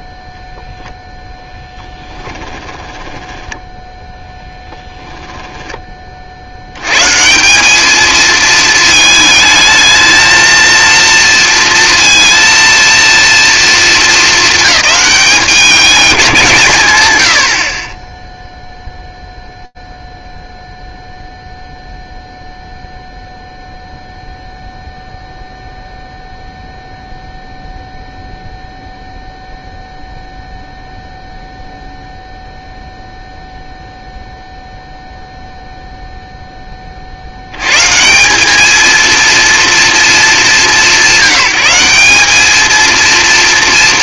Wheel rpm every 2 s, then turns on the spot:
0, 10, 10, 90, 220, 230, 230, 210, 140, 0, 0, 0, 0, 0, 0, 0, 0, 0, 30, 220, 180, 230.
2-6